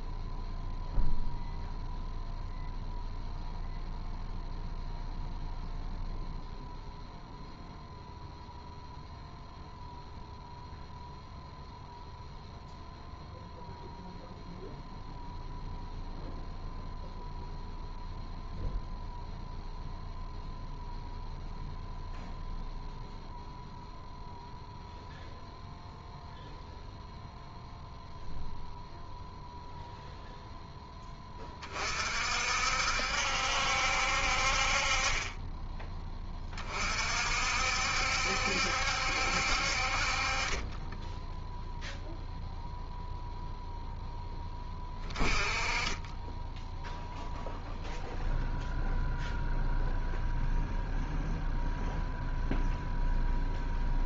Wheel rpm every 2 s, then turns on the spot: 0, 0, 0, 0, 0, 0, 0, 0, 0, 0, 0, 0, 0, 0, 0, 0, 60, 40, 30, 70, 20, 0, 20, 0, 0, 0, 0.
none